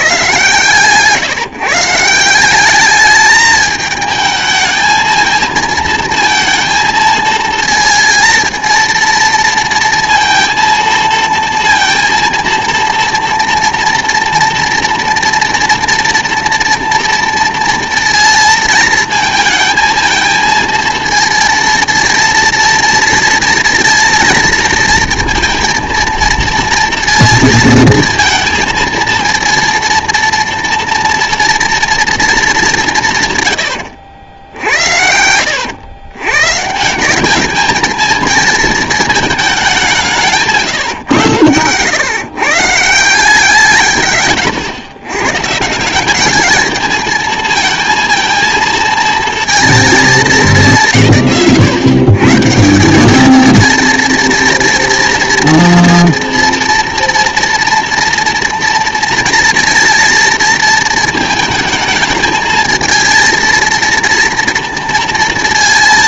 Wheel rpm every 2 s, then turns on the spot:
130, 200, 220, 230, 230, 230, 230, 230, 230, 220, 220, 230, 230, 230, 230, 230, 200, 70, 160, 220, 150, 150, 110, 220, 230, 170, 170, 240, 230, 240, 220, 230, 230.
none